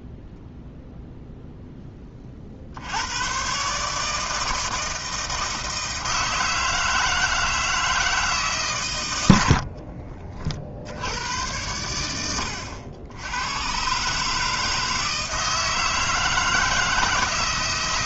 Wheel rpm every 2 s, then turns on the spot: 0, 80, 160, 160, 130, 70, 80, 160, 160.
none